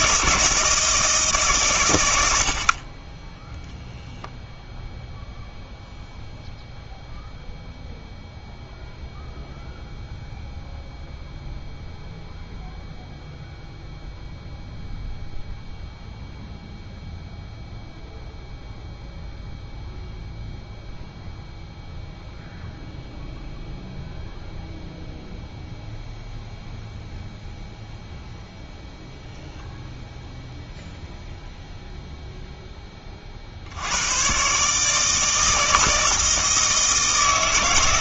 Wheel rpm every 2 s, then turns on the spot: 160, 40, 0, 0, 0, 0, 0, 0, 0, 0, 0, 0, 0, 0, 0, 0, 20, 150, 160.
none